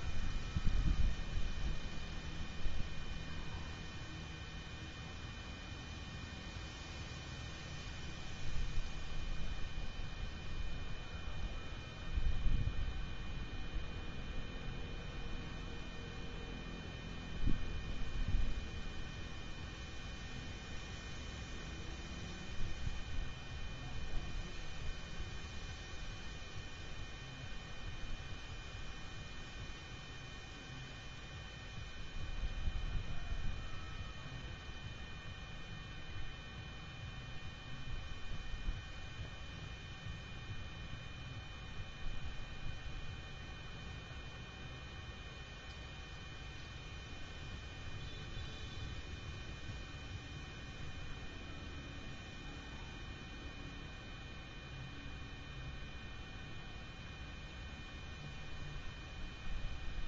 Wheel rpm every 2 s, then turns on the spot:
0, 0, 0, 0, 0, 0, 0, 0, 0, 0, 0, 0, 0, 0, 0, 0, 0, 0, 0, 0, 0, 0, 0, 0, 0, 0, 0, 0, 0, 0.
none